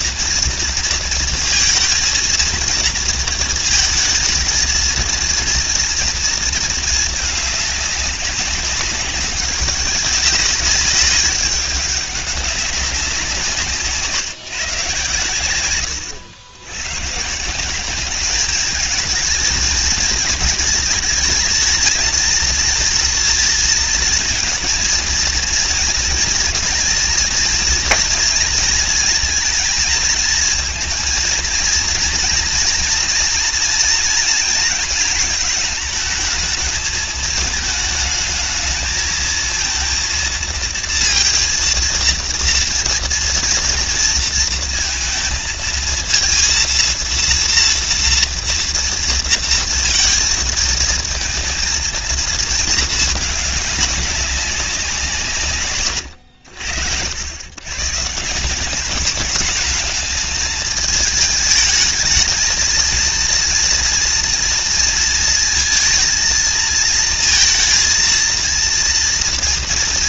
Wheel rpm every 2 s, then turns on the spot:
230, 230, 230, 220, 190, 200, 200, 140, 100, 210, 220, 230, 230, 230, 230, 230, 230, 230, 220, 220, 230, 230, 230, 230, 230, 230, 220, 190, 90, 170, 220, 220, 230, 230, 230.
none